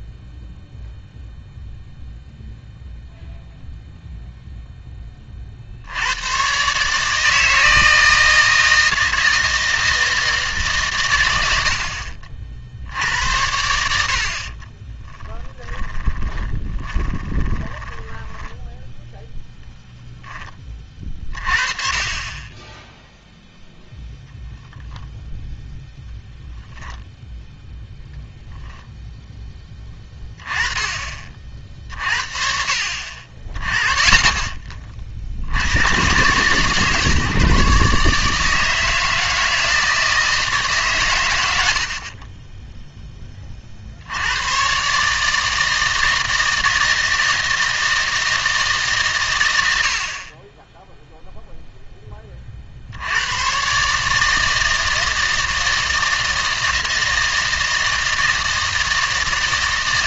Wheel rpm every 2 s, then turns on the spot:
0, 0, 0, 140, 160, 140, 70, 30, 20, 10, 20, 10, 0, 0, 10, 20, 50, 30, 140, 160, 140, 10, 120, 160, 150, 10, 60, 160, 160, 160.
14-18